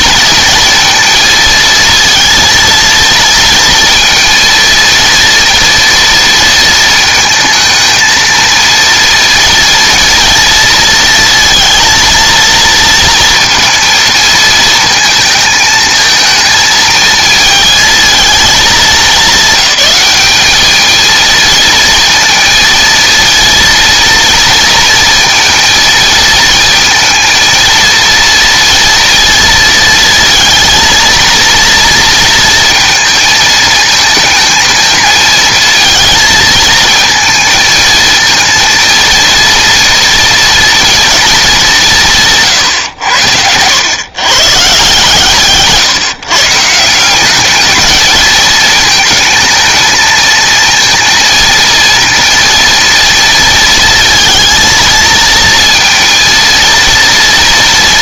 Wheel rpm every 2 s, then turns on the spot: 230, 230, 230, 220, 230, 230, 230, 220, 220, 210, 210, 230, 230, 230, 230, 230, 230, 220, 220, 230, 230, 150, 140, 150, 220, 230, 230, 230, 230.
none